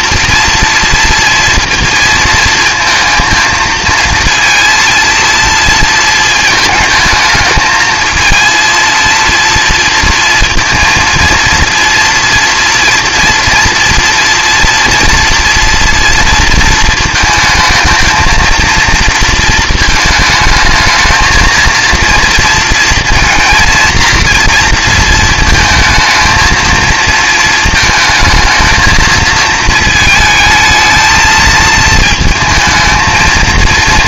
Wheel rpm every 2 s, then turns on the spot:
230, 230, 230, 220, 230, 230, 230, 240, 230, 230, 220, 230, 230, 230, 220, 220, 220.
none